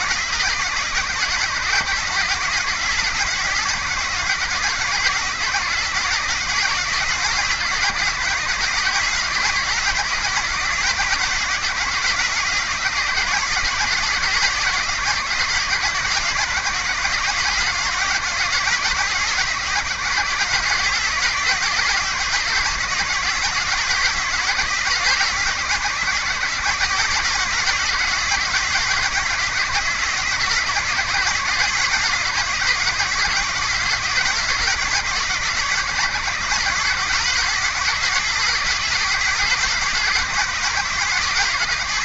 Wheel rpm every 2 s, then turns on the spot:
130, 130, 130, 130, 130, 140, 130, 130, 130, 130, 140, 140, 130, 130, 130, 140, 140, 130, 130, 140, 130.
none